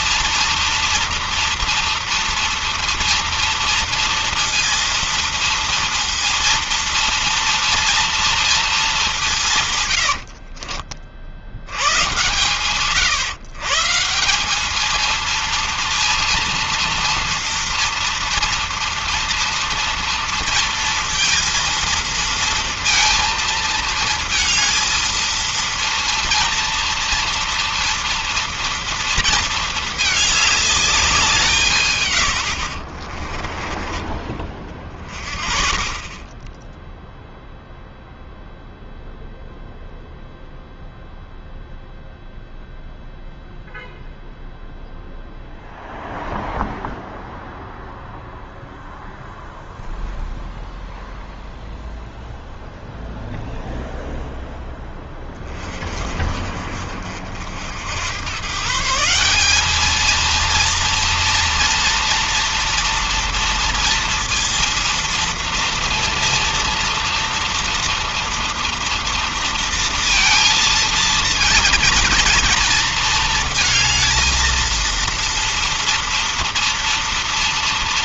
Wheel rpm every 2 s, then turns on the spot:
230, 230, 230, 230, 230, 80, 140, 200, 230, 230, 230, 230, 220, 230, 230, 210, 70, 30, 10, 0, 0, 0, 0, 0, 0, 0, 0, 0, 40, 130, 230, 230, 230, 230, 230, 230, 230, 230, 230.
10-12 32-34